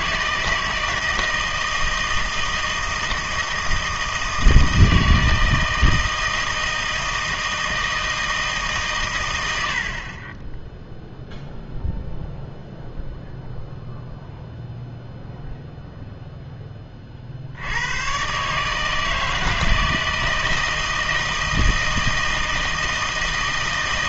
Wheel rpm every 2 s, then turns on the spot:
160, 160, 160, 160, 140, 10, 0, 0, 10, 150, 160, 160.
none